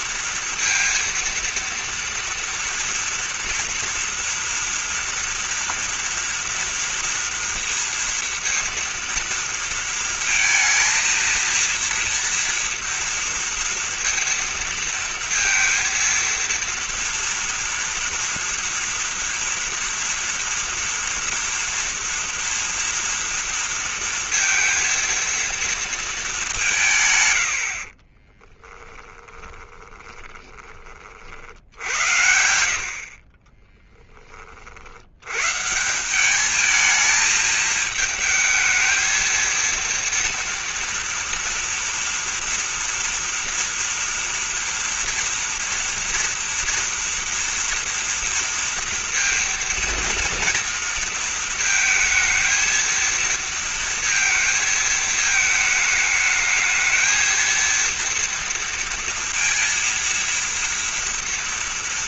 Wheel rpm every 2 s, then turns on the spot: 230, 230, 230, 230, 230, 230, 230, 230, 230, 230, 230, 230, 230, 200, 20, 20, 70, 30, 210, 220, 230, 230, 230, 230, 230, 230, 220, 230, 220, 230, 230.
28-30 32-34